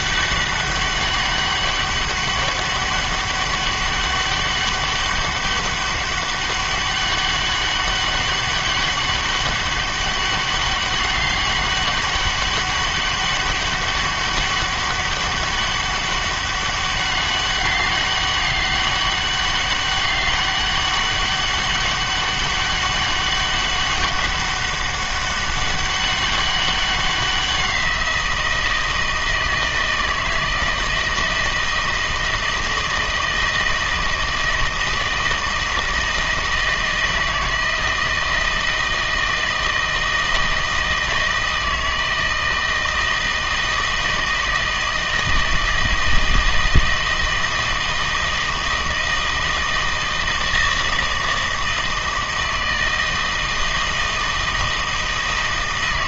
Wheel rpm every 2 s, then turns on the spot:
200, 200, 200, 200, 200, 200, 200, 200, 200, 200, 200, 200, 200, 190, 170, 160, 160, 160, 160, 160, 160, 160, 160, 160, 160, 160, 160, 160.
none